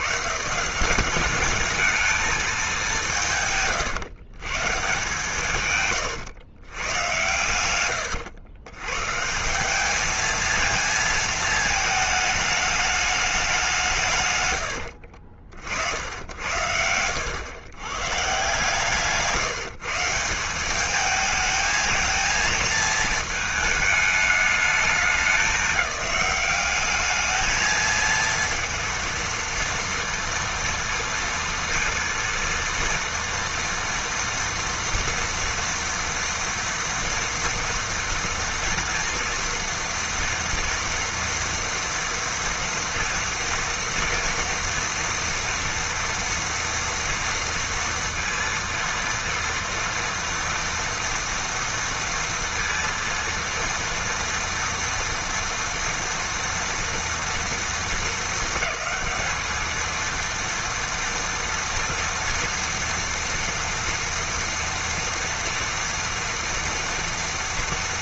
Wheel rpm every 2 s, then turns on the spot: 150, 200, 130, 120, 120, 230, 210, 100, 80, 150, 200, 220, 200, 200, 230, 230, 230, 230, 240, 230, 240, 230, 230, 230, 230, 230, 230, 230, 230, 210, 230, 230, 230, 230.
16-18